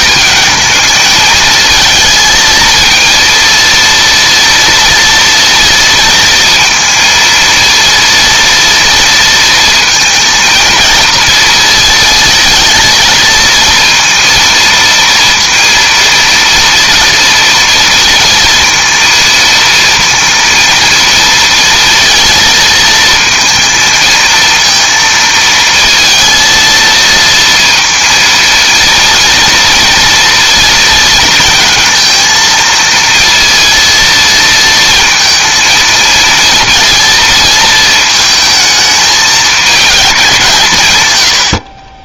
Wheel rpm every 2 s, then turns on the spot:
220, 230, 230, 230, 230, 230, 230, 230, 230, 230, 230, 230, 230, 230, 230, 230, 230, 230, 230, 220, 150.
none